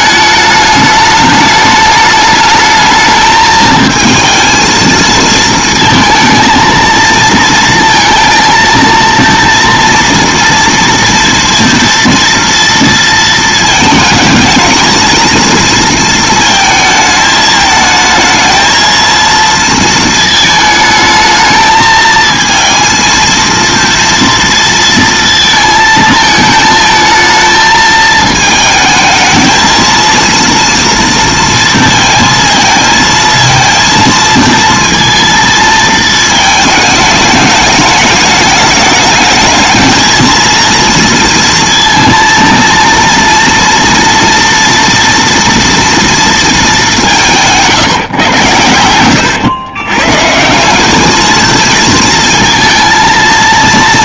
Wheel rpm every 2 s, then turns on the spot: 210, 210, 230, 230, 230, 230, 230, 220, 220, 220, 220, 230, 230, 220, 220, 230, 220, 230, 220, 210, 230, 230, 240, 220, 110, 180, 230.
none